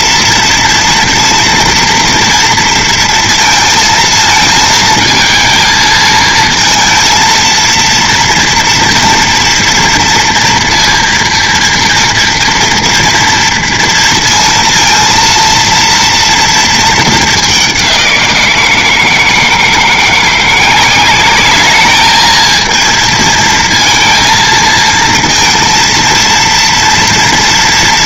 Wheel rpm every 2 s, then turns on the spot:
230, 230, 220, 230, 230, 230, 240, 230, 220, 170, 180, 220, 230, 230.
none